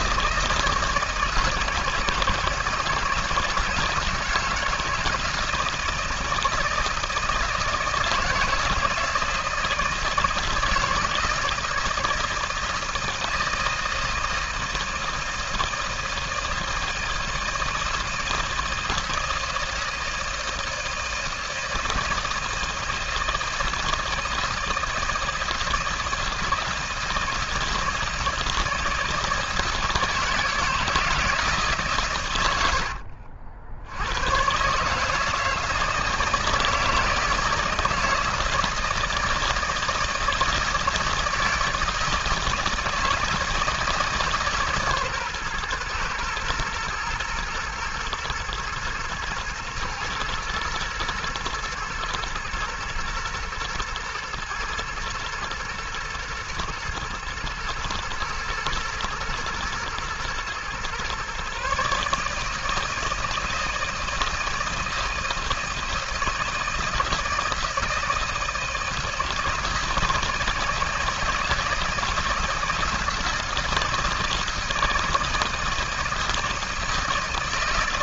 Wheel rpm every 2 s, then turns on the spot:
160, 160, 160, 160, 160, 160, 160, 160, 160, 160, 160, 160, 160, 160, 160, 160, 80, 140, 160, 160, 160, 160, 140, 120, 120, 110, 120, 110, 110, 110, 120, 160, 160, 160, 160, 160, 160, 160, 160.
none